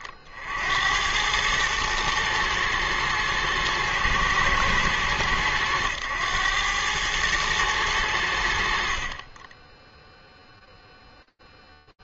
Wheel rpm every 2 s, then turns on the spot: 60, 110, 110, 100, 70, 0.
none